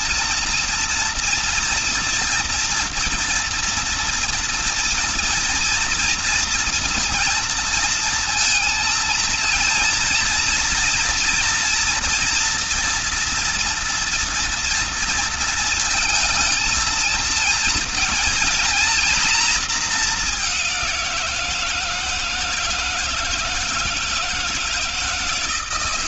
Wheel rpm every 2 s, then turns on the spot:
230, 230, 230, 230, 220, 230, 230, 230, 230, 240, 190, 160, 160.
none